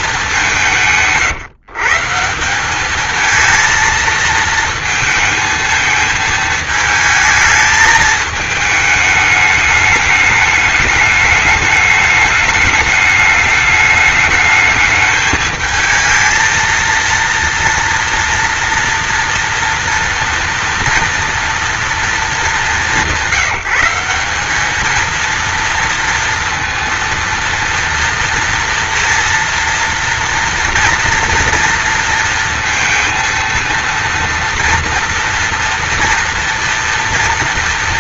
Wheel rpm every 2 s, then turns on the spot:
160, 200, 220, 220, 210, 210, 210, 220, 230, 230, 240, 180, 220, 230, 230, 230, 230, 230, 230.
none